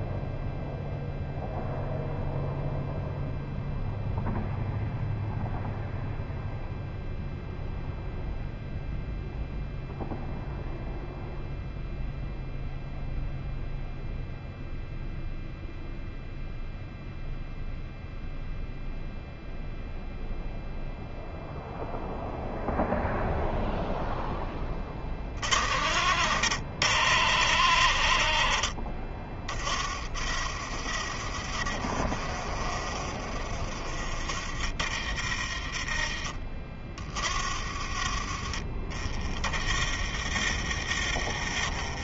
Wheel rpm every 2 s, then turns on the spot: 0, 0, 0, 0, 0, 0, 0, 0, 0, 0, 0, 0, 20, 90, 60, 40, 30, 30, 20, 30, 40.
none